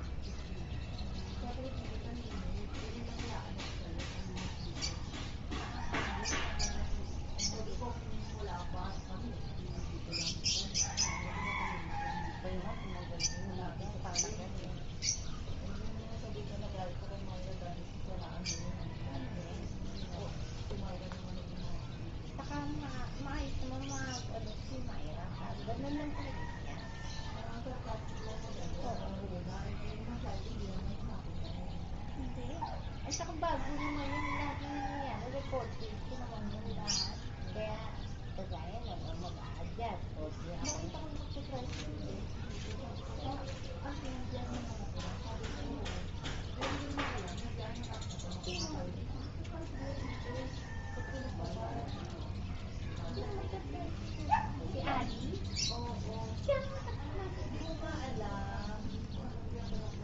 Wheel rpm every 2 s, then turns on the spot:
0, 0, 0, 0, 0, 0, 0, 0, 0, 0, 0, 0, 0, 0, 0, 0, 0, 0, 0, 0, 0, 0, 0, 0, 0, 0, 0, 0, 0, 0.
none